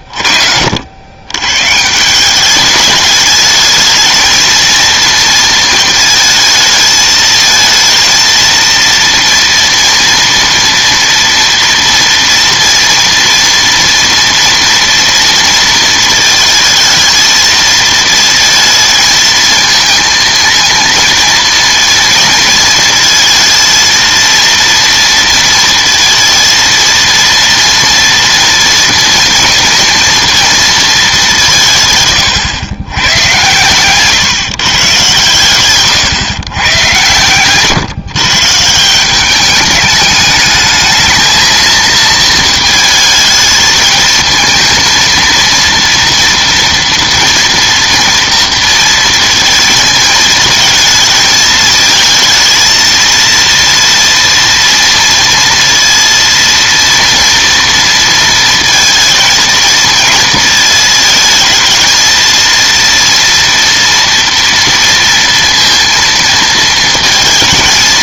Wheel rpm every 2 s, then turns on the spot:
60, 210, 230, 220, 230, 230, 230, 230, 220, 220, 230, 230, 230, 230, 230, 230, 110, 140, 110, 160, 220, 220, 230, 230, 230, 220, 220, 230, 230, 230, 220, 230, 230, 230.
none